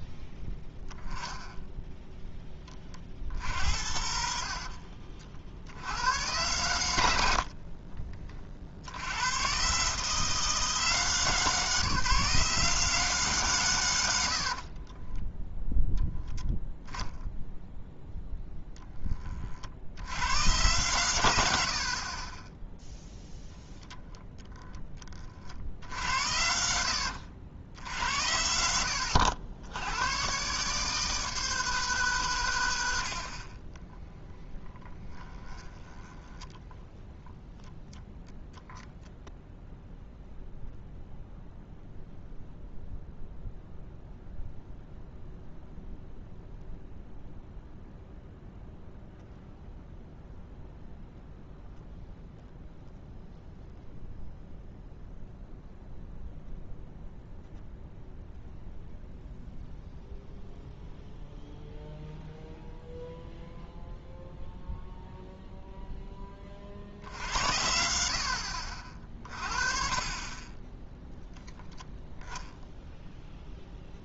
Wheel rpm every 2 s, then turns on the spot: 10, 20, 60, 110, 50, 160, 150, 50, 0, 10, 100, 10, 10, 70, 70, 140, 110, 20, 10, 0, 0, 0, 0, 0, 0, 0, 0, 0, 0, 0, 0, 0, 0, 40, 50, 10, 0.
0-2 4-6 14-16 34-38